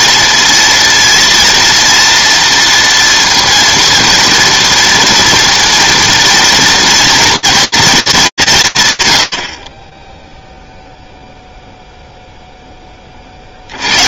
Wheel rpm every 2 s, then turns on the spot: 230, 230, 230, 230, 150, 0, 10.
none